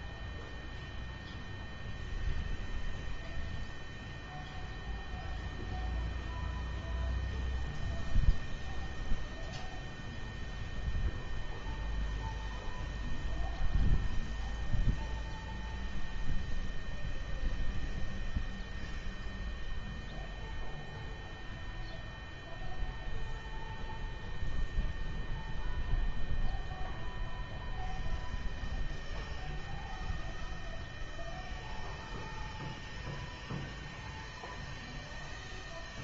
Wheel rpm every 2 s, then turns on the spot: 0, 0, 0, 0, 0, 0, 0, 0, 0, 0, 0, 0, 0, 0, 0, 0, 0, 0.
none